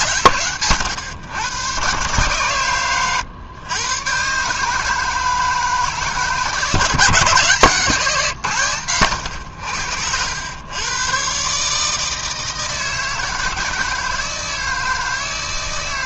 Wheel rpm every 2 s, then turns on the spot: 120, 120, 150, 150, 130, 100, 160, 160.
none